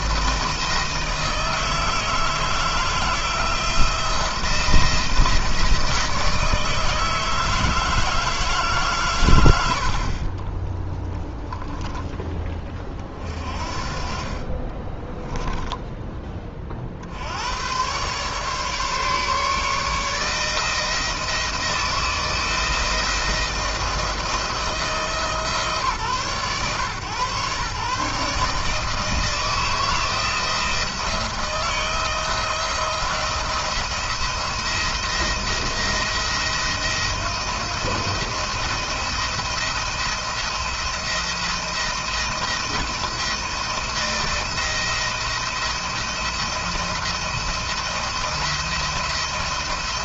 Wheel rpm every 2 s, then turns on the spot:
170, 160, 160, 160, 150, 30, 20, 30, 40, 140, 160, 160, 160, 130, 150, 170, 170, 170, 170, 170, 170, 170, 170, 170, 170.
10-12 14-16